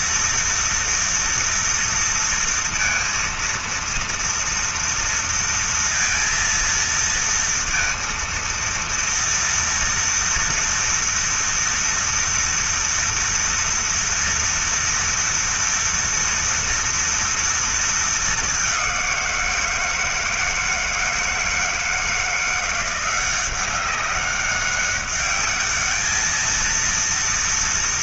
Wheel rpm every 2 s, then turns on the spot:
230, 230, 230, 230, 230, 230, 230, 230, 230, 210, 160, 170, 190, 220.
none